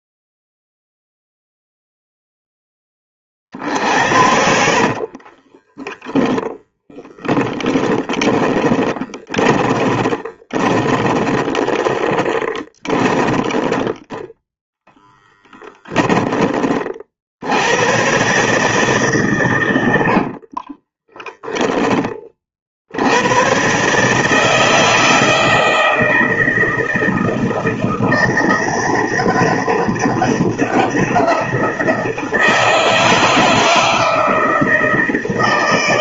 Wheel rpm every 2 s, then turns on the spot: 0, 10, 60, 10, 20, 10, 10, 10, 30, 140, 30, 70, 160, 160, 180, 190, 160, 160.
4-6 8-16 20-22